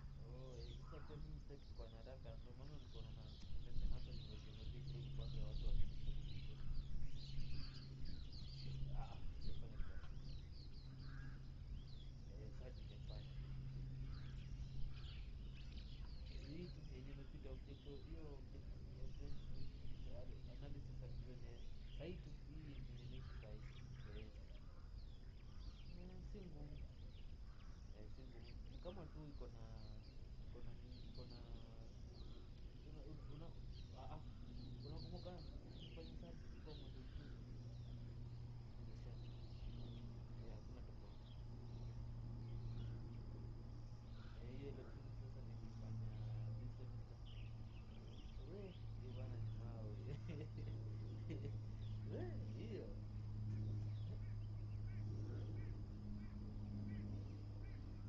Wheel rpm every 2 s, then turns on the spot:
0, 0, 0, 0, 0, 0, 0, 0, 0, 0, 0, 0, 0, 0, 0, 0, 0, 0, 0, 0, 0, 0, 0, 0, 0, 0, 0, 0, 0.
none